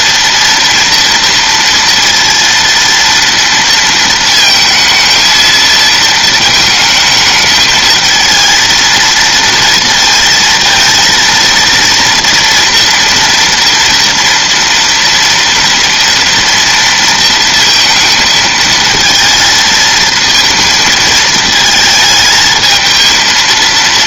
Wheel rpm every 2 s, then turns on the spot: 230, 230, 220, 220, 230, 230, 230, 230, 230, 230, 230, 220.
none